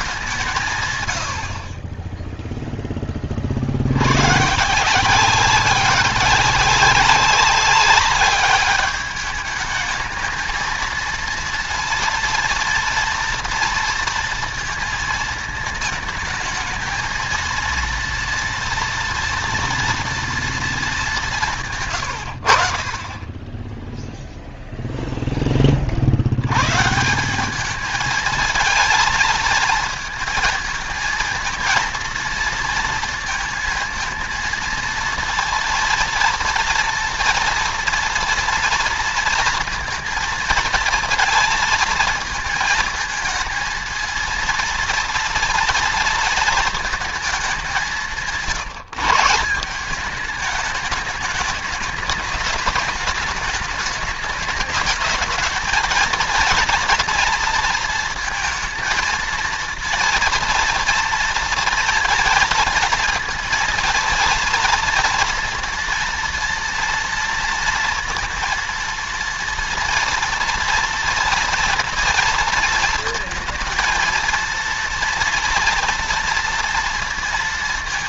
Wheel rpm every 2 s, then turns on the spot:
130, 10, 170, 190, 210, 230, 230, 230, 220, 230, 210, 40, 0, 140, 220, 220, 230, 230, 230, 230, 230, 230, 230, 230, 160, 210, 210, 220, 230, 230, 230, 230, 230, 230, 230, 240, 230, 230, 230.
none